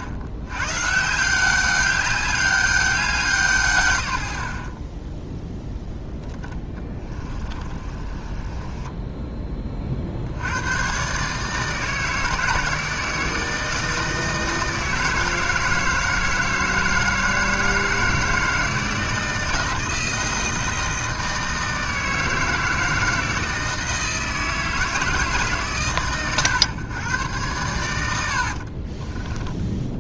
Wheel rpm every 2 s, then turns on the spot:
90, 200, 70, 10, 20, 90, 160, 160, 160, 160, 160, 160, 160, 120, 50.
6-10 28-30